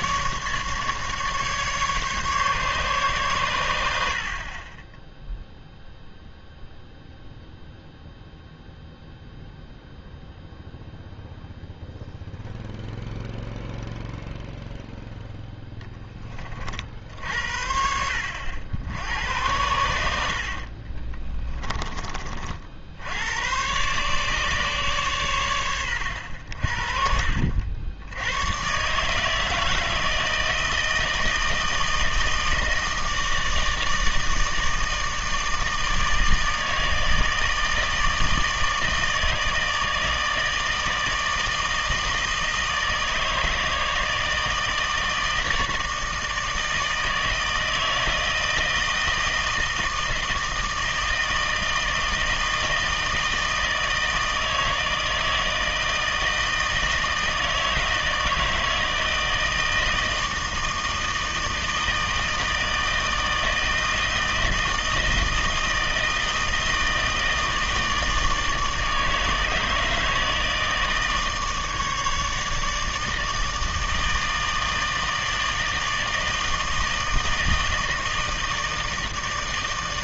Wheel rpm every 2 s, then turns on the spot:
150, 140, 20, 0, 0, 0, 0, 0, 50, 90, 40, 60, 140, 60, 130, 160, 160, 160, 160, 160, 160, 160, 160, 160, 160, 160, 160, 160, 160, 160, 160, 160, 160, 160, 160, 160, 150, 160, 160, 160.
20-22